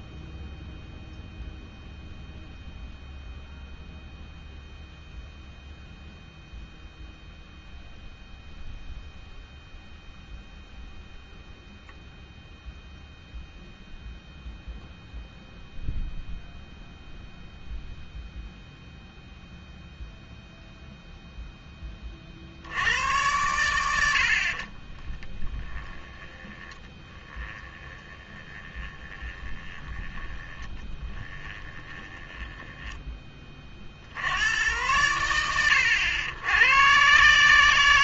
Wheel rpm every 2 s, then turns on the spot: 0, 0, 0, 0, 0, 0, 0, 0, 0, 0, 0, 70, 40, 10, 20, 10, 10, 110, 110.
24-34